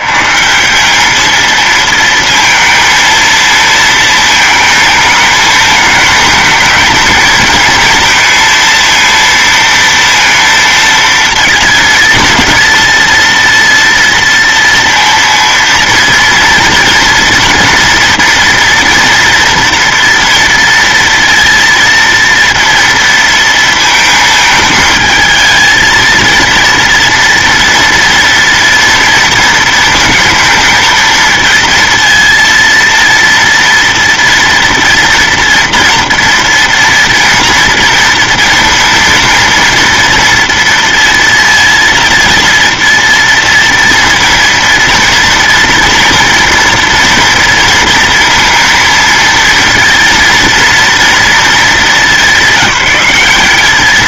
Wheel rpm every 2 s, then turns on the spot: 90, 230, 220, 220, 230, 230, 230, 230, 230, 230, 230, 230, 220, 230, 230, 230, 230, 240, 230, 230, 230, 230, 230, 230, 230, 230, 200.
none